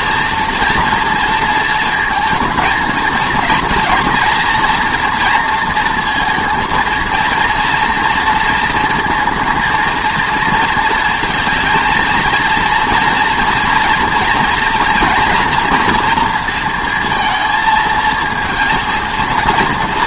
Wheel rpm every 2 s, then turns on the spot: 230, 230, 240, 230, 230, 230, 230, 230, 230, 220.
none